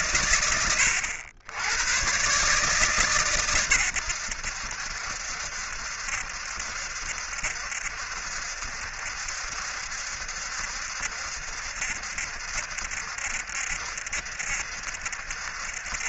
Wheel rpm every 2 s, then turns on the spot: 80, 120, 70, 70, 70, 70, 70, 60.
none